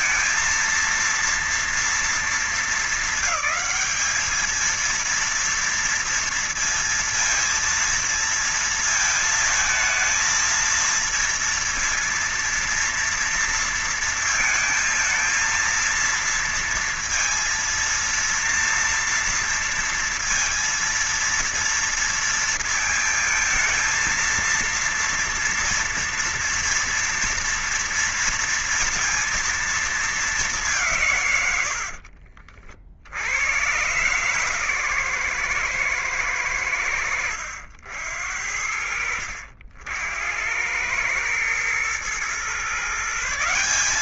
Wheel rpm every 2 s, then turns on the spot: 230, 230, 220, 230, 230, 220, 230, 230, 230, 230, 230, 230, 230, 230, 230, 210, 70, 130, 110, 70, 80, 120.
32-34